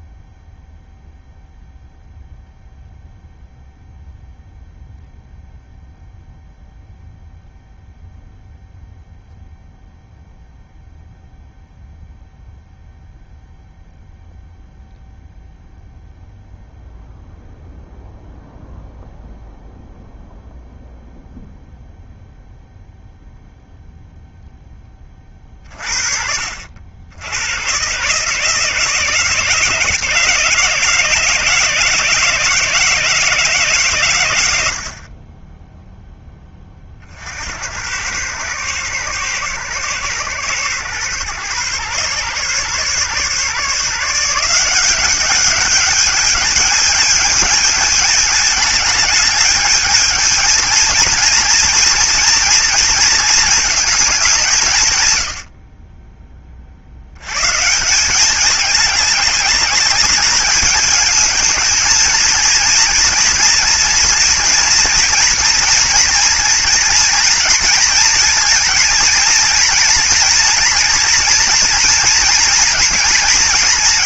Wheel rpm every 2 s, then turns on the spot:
0, 0, 0, 0, 0, 0, 0, 0, 0, 0, 0, 0, 10, 70, 160, 160, 160, 80, 20, 110, 120, 130, 180, 210, 210, 230, 230, 150, 50, 210, 210, 230, 230, 230, 230, 230, 230.
none